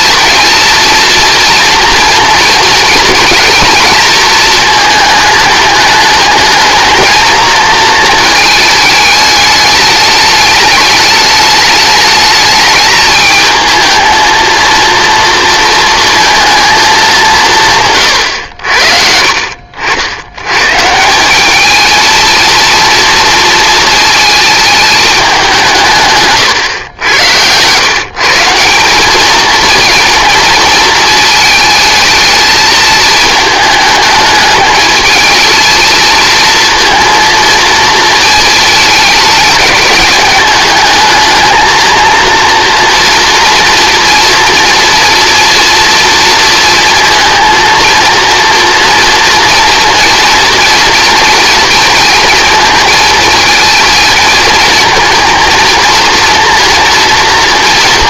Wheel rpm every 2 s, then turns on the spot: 230, 230, 220, 220, 220, 210, 210, 230, 230, 90, 120, 230, 220, 120, 180, 220, 220, 210, 230, 220, 210, 230, 230, 230, 230, 240, 230, 230, 230.
none